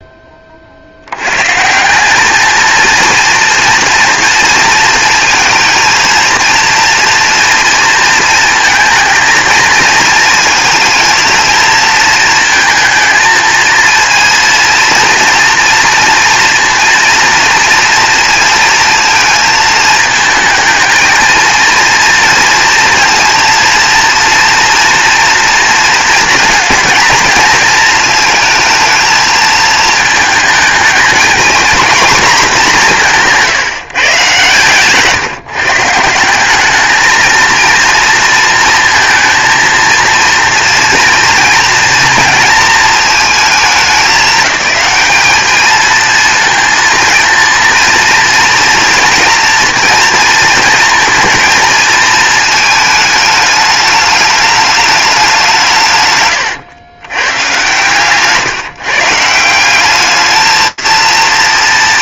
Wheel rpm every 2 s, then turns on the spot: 80, 230, 230, 230, 230, 230, 220, 230, 230, 230, 220, 230, 240, 230, 220, 220, 200, 140, 220, 230, 230, 220, 200, 230, 240, 230, 220, 210, 110, 140, 220.
none